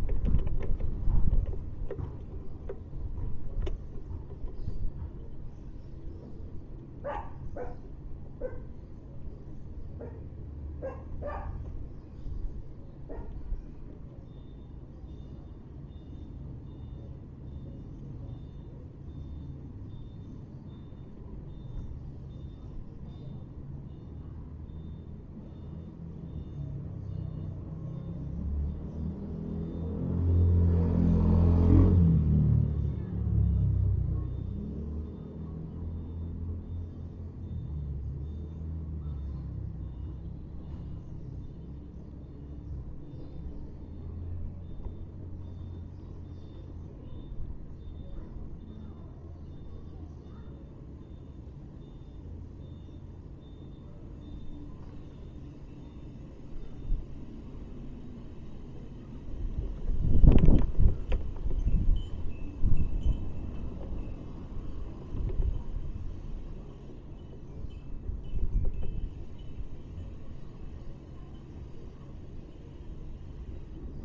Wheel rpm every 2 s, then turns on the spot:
0, 0, 0, 0, 0, 0, 0, 0, 0, 0, 0, 0, 0, 0, 0, 0, 0, 0, 0, 0, 0, 0, 0, 0, 0, 0, 0, 0, 0, 0, 0, 0, 0, 0, 0, 0, 0.
none